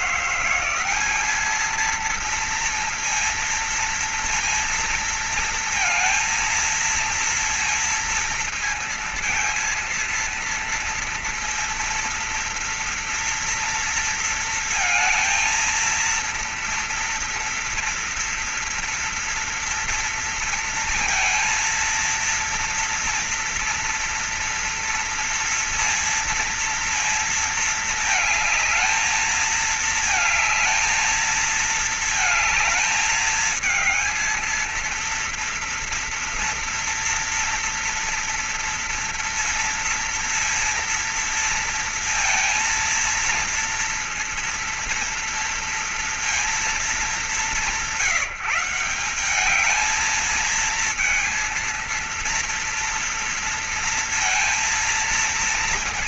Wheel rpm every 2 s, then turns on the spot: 210, 230, 230, 230, 230, 230, 230, 220, 230, 240, 230, 230, 230, 230, 220, 220, 220, 230, 230, 230, 230, 230, 230, 180, 190, 230, 230, 230.
none